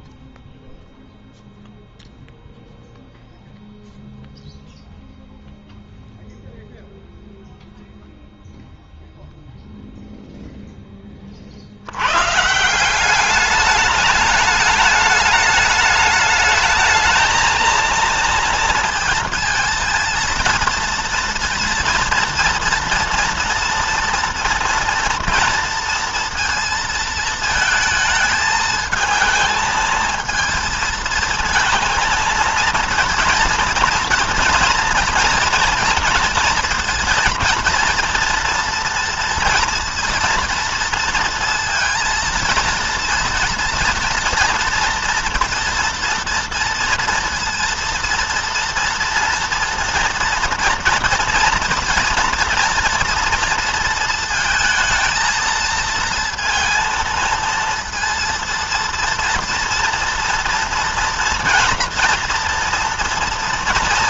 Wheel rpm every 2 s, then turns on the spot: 0, 0, 0, 0, 0, 0, 140, 210, 210, 230, 230, 230, 230, 230, 220, 230, 230, 230, 230, 230, 230, 230, 230, 230, 230, 230, 230, 230, 230, 230, 240, 230.
none